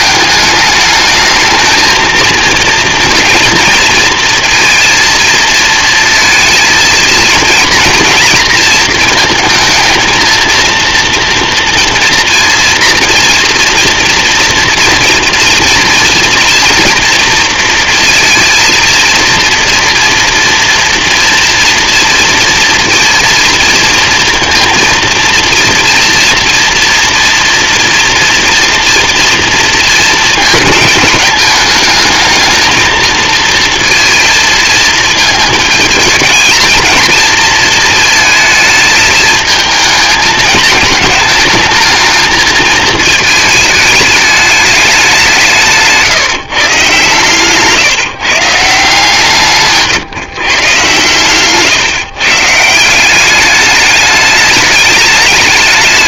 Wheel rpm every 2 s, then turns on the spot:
210, 230, 230, 230, 230, 230, 240, 230, 230, 230, 230, 230, 230, 230, 240, 220, 220, 230, 220, 220, 210, 220, 210, 140, 150, 140, 150, 210.
none